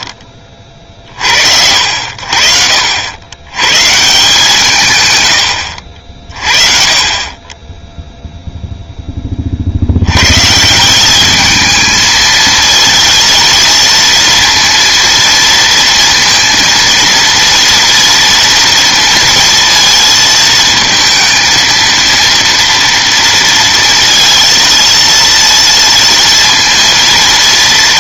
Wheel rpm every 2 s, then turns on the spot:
20, 60, 160, 40, 0, 170, 230, 230, 230, 230, 220, 230, 230, 230.
none